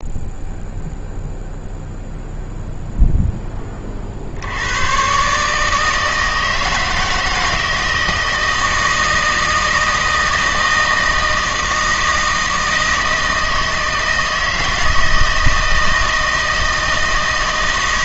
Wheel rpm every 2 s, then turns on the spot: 0, 0, 100, 160, 160, 160, 160, 160, 160.
none